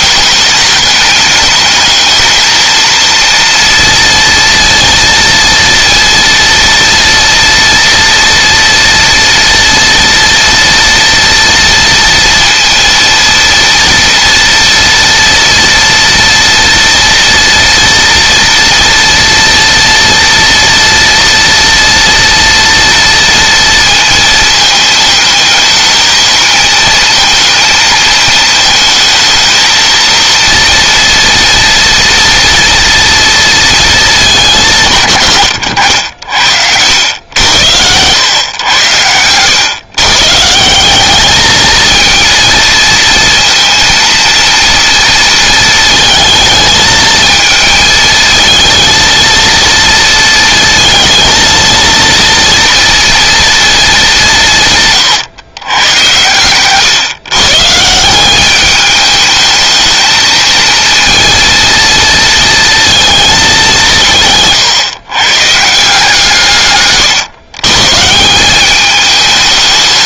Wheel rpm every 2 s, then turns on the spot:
210, 230, 230, 230, 230, 230, 230, 230, 230, 230, 240, 230, 220, 230, 220, 240, 230, 150, 90, 100, 190, 230, 230, 220, 230, 230, 230, 130, 130, 210, 230, 230, 130, 140, 210.
none